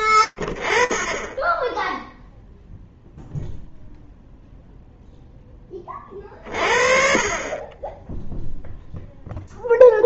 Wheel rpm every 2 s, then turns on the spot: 0, 0, 40, 0, 20.
8-10